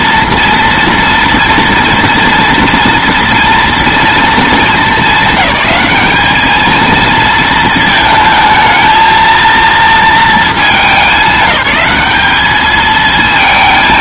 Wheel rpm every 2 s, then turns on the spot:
230, 230, 220, 220, 220, 190, 220.
none